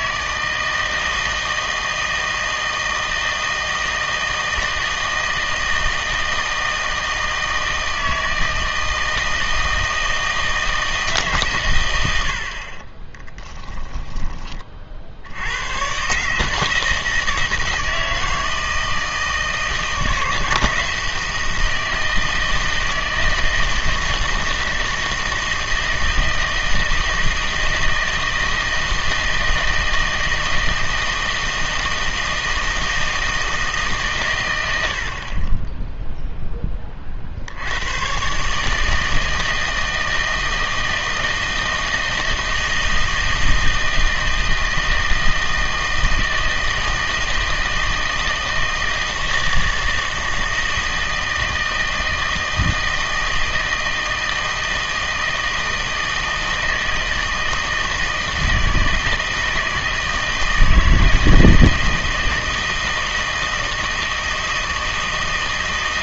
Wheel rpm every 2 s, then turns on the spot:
160, 160, 160, 160, 160, 160, 40, 30, 160, 160, 160, 160, 160, 160, 160, 160, 160, 90, 20, 150, 160, 160, 160, 160, 160, 160, 160, 160, 160, 160, 160, 160, 160.
none